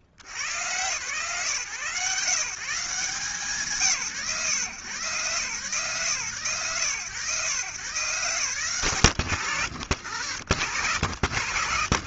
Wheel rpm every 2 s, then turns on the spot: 90, 160, 110, 130, 140, 80.
none